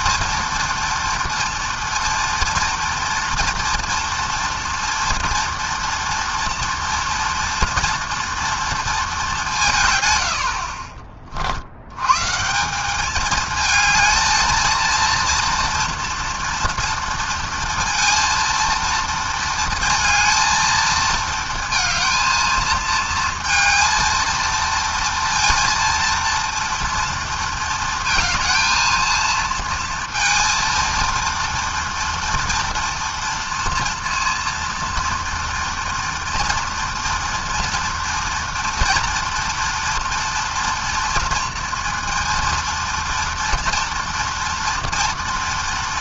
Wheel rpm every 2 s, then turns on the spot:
230, 230, 230, 230, 230, 50, 160, 230, 230, 230, 230, 220, 230, 230, 220, 230, 230, 230, 240, 240, 240, 230, 230.
none